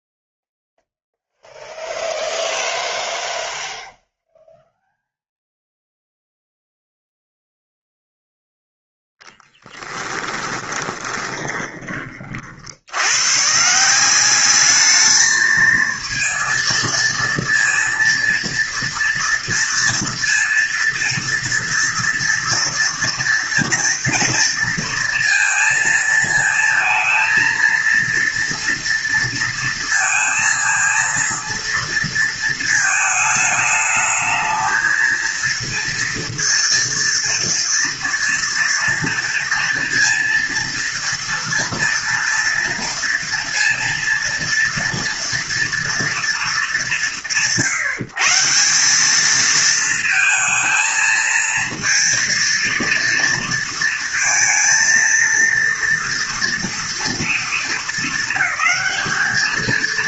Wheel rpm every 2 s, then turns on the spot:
0, 0, 0, 0, 0, 20, 60, 210, 230, 230, 230, 230, 230, 220, 230, 230, 220, 220, 230, 230, 230, 230, 230, 190, 180, 230, 230, 230, 230, 200.
10-12